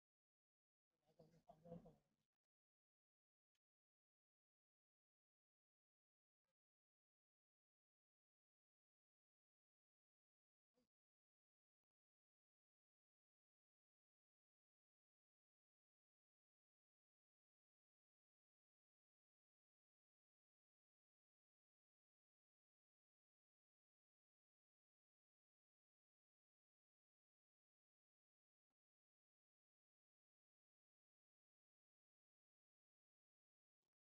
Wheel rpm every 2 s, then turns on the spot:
0, 0, 0, 0, 0, 0, 0, 0, 0, 0, 0, 0, 0, 0, 0, 0, 0.
none